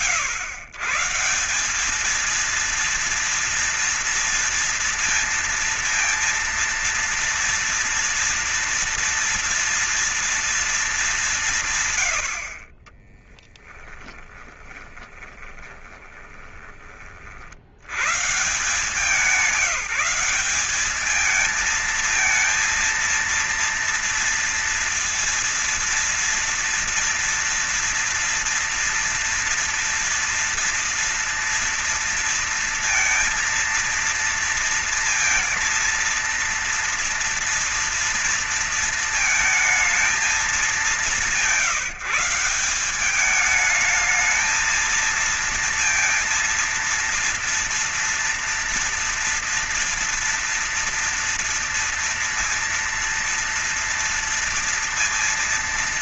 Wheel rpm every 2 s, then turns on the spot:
130, 230, 230, 230, 230, 230, 60, 20, 20, 150, 200, 230, 240, 230, 230, 230, 230, 230, 230, 230, 200, 180, 220, 230, 230, 230, 230, 230.
12-16